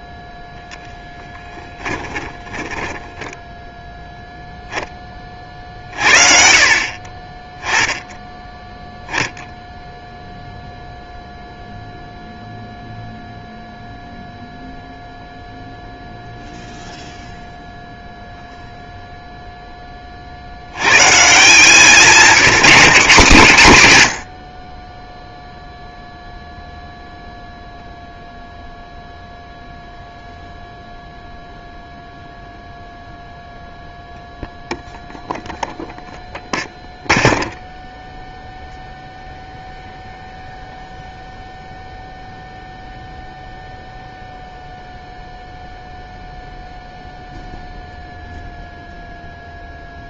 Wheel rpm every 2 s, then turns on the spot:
0, 20, 0, 40, 10, 0, 0, 0, 0, 0, 70, 200, 50, 0, 0, 0, 0, 0, 0, 0, 0, 0, 0, 0, 0.
2-4